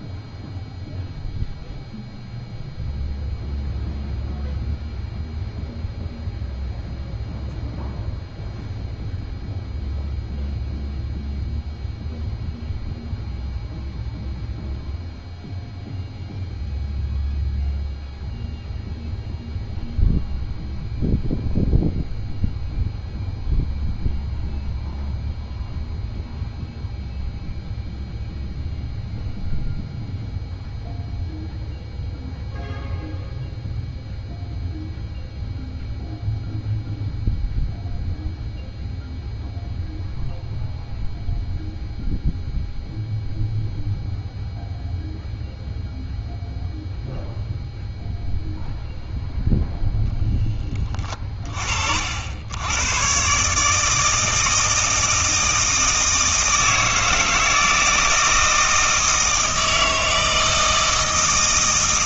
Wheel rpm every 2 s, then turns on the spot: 0, 0, 0, 0, 0, 0, 0, 0, 0, 0, 0, 0, 0, 0, 0, 0, 0, 0, 0, 0, 0, 0, 0, 0, 0, 10, 100, 160, 160, 160, 160.
none